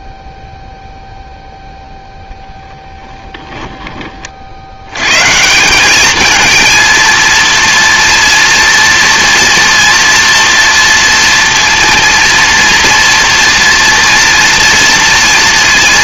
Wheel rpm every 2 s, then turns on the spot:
0, 0, 40, 220, 230, 230, 230, 230.
none